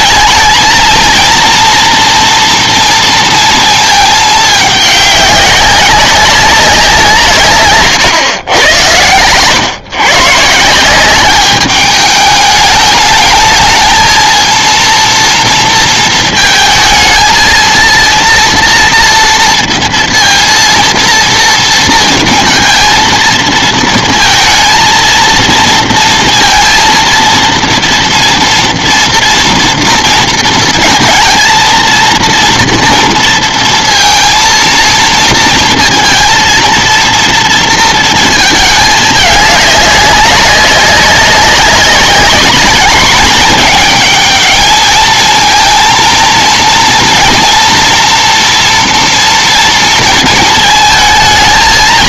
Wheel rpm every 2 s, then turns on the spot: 230, 230, 200, 140, 120, 200, 220, 230, 230, 230, 230, 230, 230, 230, 230, 230, 230, 230, 230, 210, 190, 210, 220, 230, 230, 220.
none